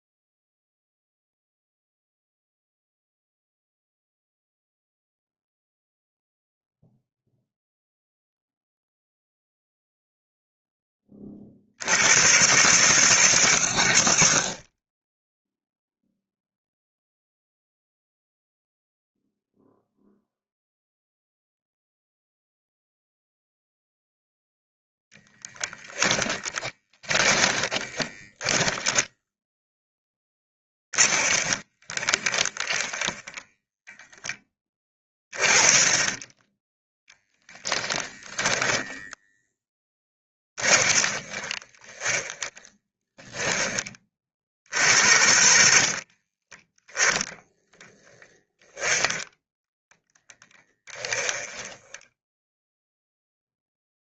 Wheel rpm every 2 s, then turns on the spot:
0, 0, 0, 0, 0, 20, 120, 20, 0, 0, 0, 0, 0, 20, 10, 20, 10, 20, 10, 0, 30, 10, 50, 10, 10, 10, 0.
26-34 40-46 48-52